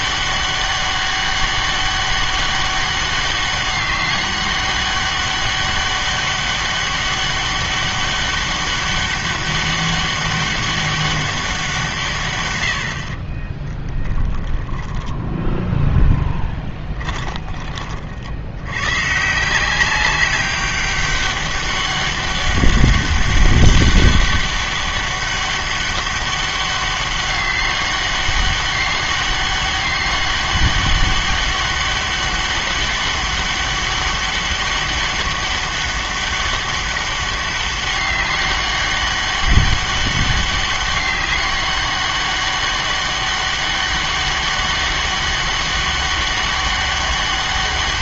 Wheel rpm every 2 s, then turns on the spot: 200, 200, 200, 200, 200, 200, 90, 10, 10, 90, 200, 200, 200, 200, 200, 200, 200, 200, 200, 200, 200, 200, 200, 200.
14-18